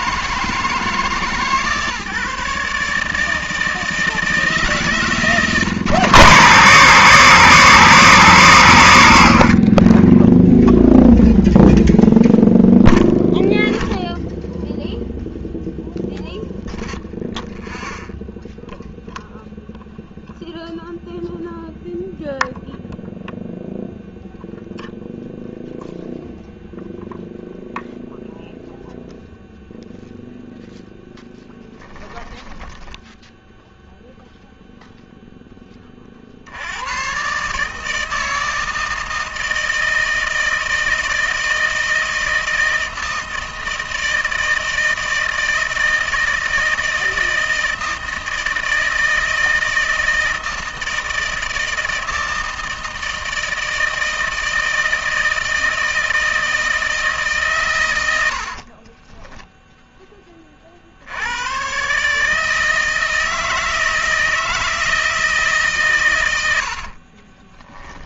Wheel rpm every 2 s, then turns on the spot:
150, 160, 140, 140, 70, 0, 0, 0, 0, 0, 0, 0, 0, 0, 0, 0, 10, 0, 100, 160, 160, 160, 160, 160, 160, 160, 160, 160, 160, 40, 30, 160, 160, 90.
58-60